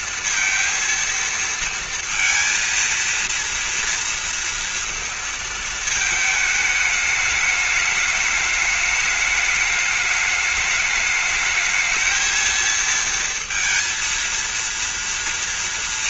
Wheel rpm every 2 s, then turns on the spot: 230, 230, 230, 210, 210, 210, 220, 230.
none